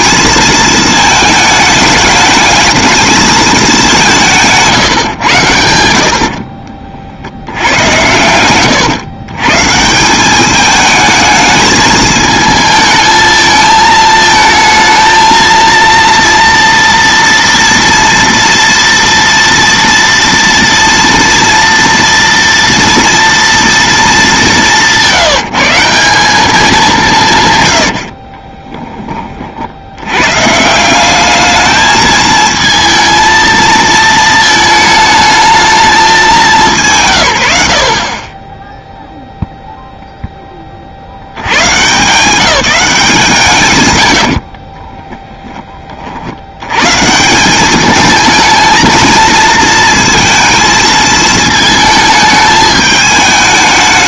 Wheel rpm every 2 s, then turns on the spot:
220, 220, 160, 50, 110, 210, 220, 220, 230, 230, 230, 230, 190, 190, 30, 160, 220, 220, 170, 10, 30, 180, 30, 100, 220, 220, 220.
4-8 28-30 44-46